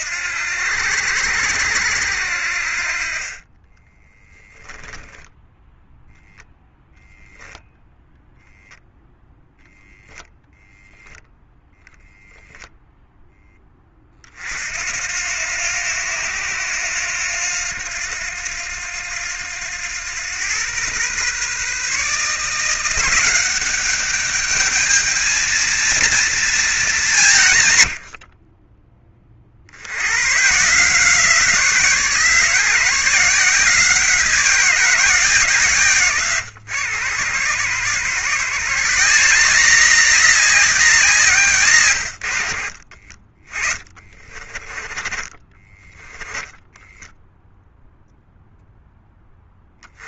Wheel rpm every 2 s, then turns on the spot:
80, 20, 0, 0, 0, 0, 10, 90, 90, 90, 130, 190, 220, 150, 20, 170, 180, 170, 100, 170, 160, 30, 20, 0, 0.
44-46